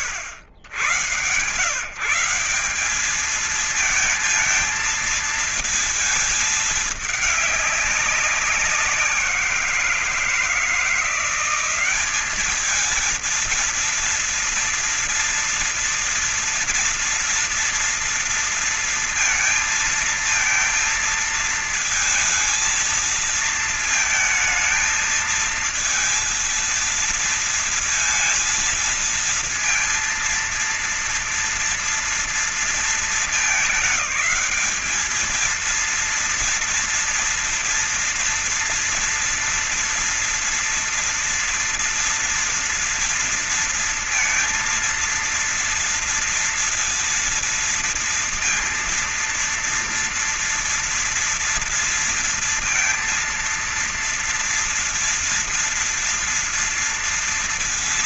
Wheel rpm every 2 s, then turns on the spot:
110, 190, 220, 220, 180, 170, 210, 230, 240, 230, 230, 230, 220, 230, 230, 230, 230, 210, 230, 230, 230, 230, 230, 240, 240, 230, 230, 230, 230.
none